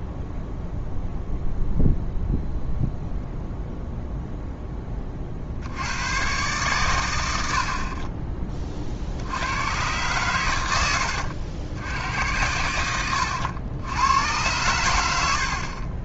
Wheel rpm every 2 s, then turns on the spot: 0, 0, 0, 120, 40, 110, 90, 110.
none